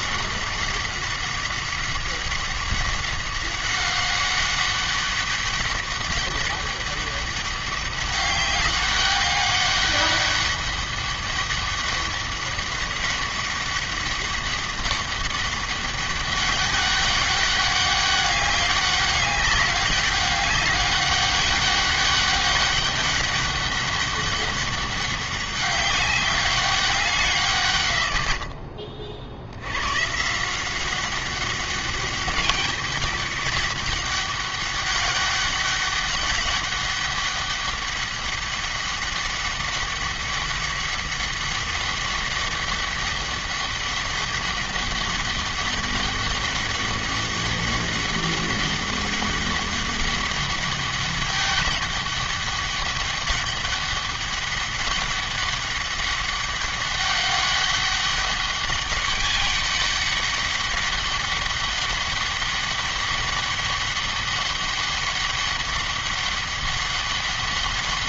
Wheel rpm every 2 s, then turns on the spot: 190, 190, 200, 200, 200, 200, 200, 200, 200, 200, 200, 200, 200, 190, 50, 180, 200, 200, 200, 200, 200, 200, 200, 200, 200, 200, 200, 200, 200, 200, 200, 200, 200, 200.
none